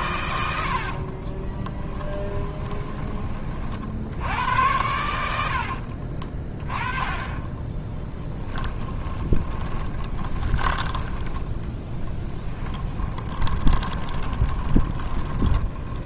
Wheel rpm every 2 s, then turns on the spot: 70, 20, 90, 20, 20, 20, 10, 20.
0-4 6-16